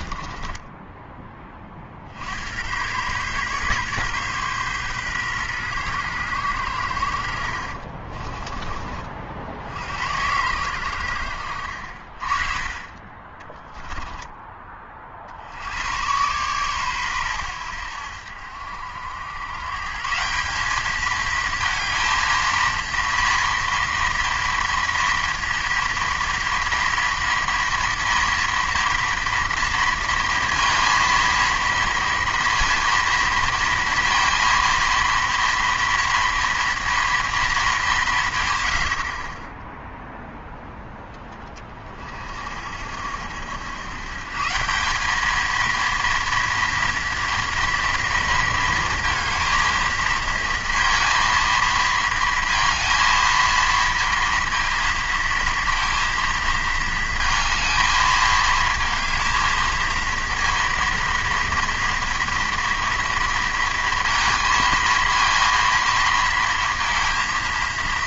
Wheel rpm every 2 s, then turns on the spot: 20, 100, 130, 90, 30, 100, 30, 30, 120, 80, 210, 230, 230, 230, 230, 230, 230, 230, 230, 100, 0, 60, 180, 230, 230, 230, 230, 230, 230, 220, 230, 230, 230, 230.
0-2